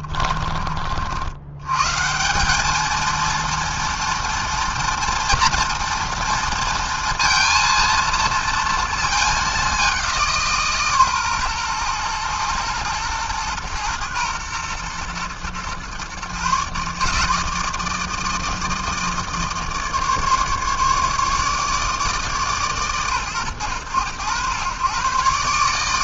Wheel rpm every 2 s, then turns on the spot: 90, 230, 230, 230, 220, 130, 120, 120, 160, 160, 150, 110, 130.
none